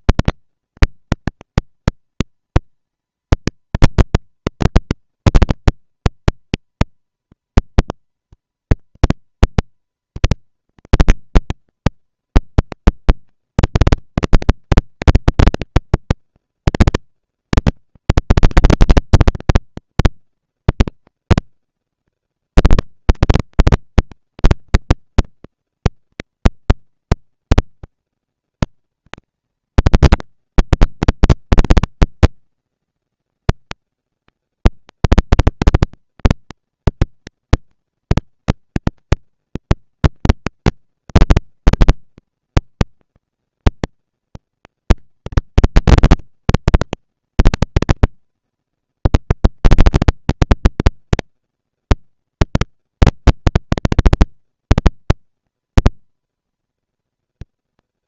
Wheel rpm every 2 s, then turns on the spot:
230, 230, 230, 230, 230, 230, 230, 230, 230, 230, 230, 230, 220, 230, 230, 200, 200, 210, 230, 230, 230, 230, 230, 230, 230, 240, 230, 230, 230.
none